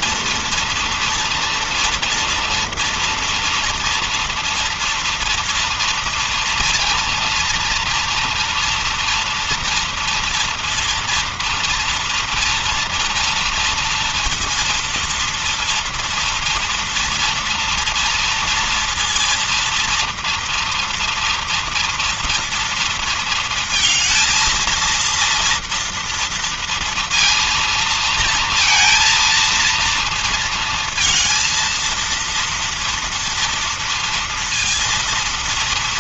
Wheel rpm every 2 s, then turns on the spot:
230, 230, 230, 230, 230, 230, 230, 230, 240, 230, 230, 230, 230, 230, 230, 230, 230, 230.
none